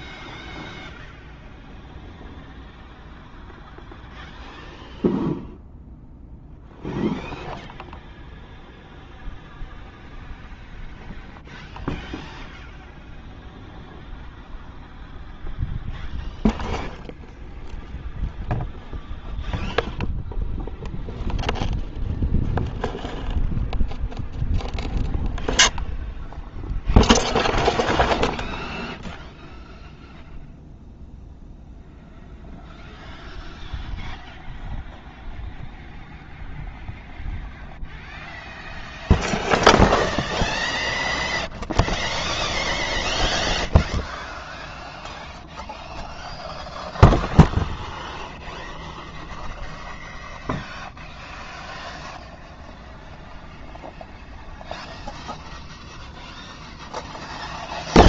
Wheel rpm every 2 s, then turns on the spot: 0, 0, 0, 0, 0, 0, 0, 0, 0, 0, 0, 0, 0, 0, 0, 0, 0, 0, 0, 0, 0, 0, 0, 0, 0, 0, 0, 0, 0.
none